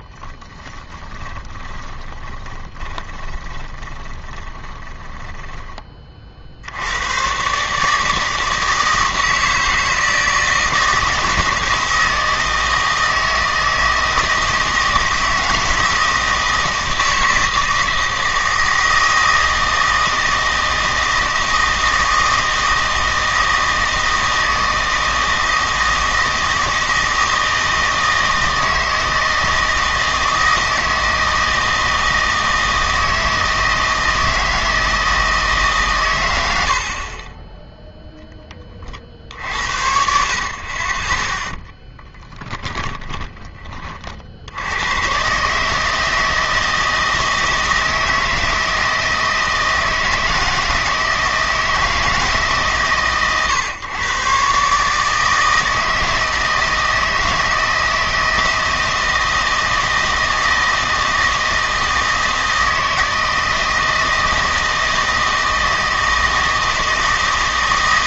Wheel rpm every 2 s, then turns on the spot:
20, 30, 20, 80, 160, 160, 160, 160, 160, 160, 160, 160, 160, 160, 160, 160, 160, 160, 80, 30, 30, 20, 100, 160, 160, 160, 140, 140, 160, 160, 160, 160, 160, 160.
0-6 42-44